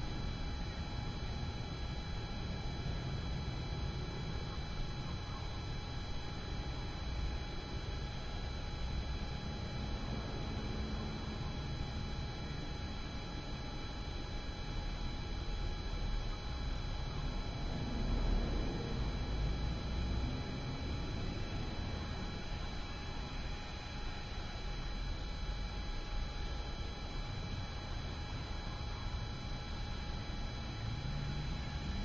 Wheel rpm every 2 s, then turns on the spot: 0, 0, 0, 0, 0, 0, 0, 0, 0, 0, 0, 0, 0, 0, 0, 0.
none